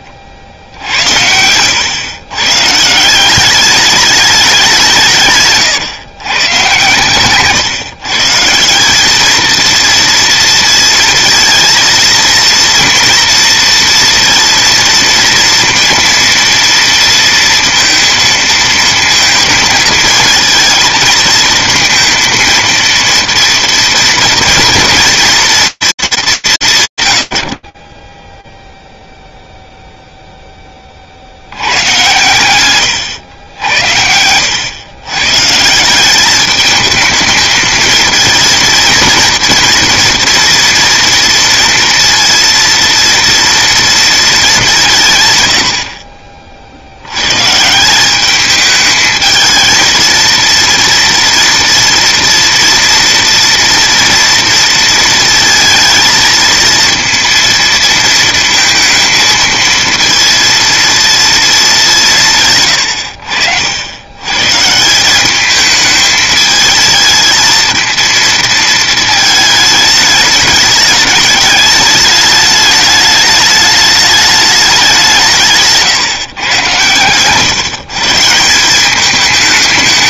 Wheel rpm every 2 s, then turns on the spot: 50, 120, 200, 120, 170, 230, 230, 230, 230, 230, 220, 230, 230, 170, 0, 10, 120, 110, 220, 230, 240, 230, 180, 80, 220, 240, 230, 230, 230, 230, 230, 100, 180, 220, 220, 210, 210, 190, 120, 190.
none